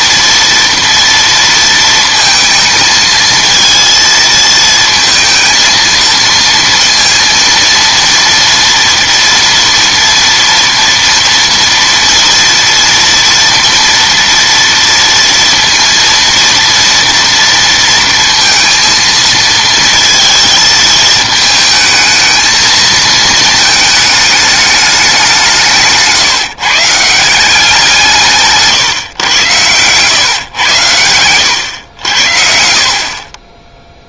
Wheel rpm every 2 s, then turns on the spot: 230, 230, 220, 230, 230, 230, 230, 230, 230, 230, 220, 220, 210, 150, 150, 100, 60.
none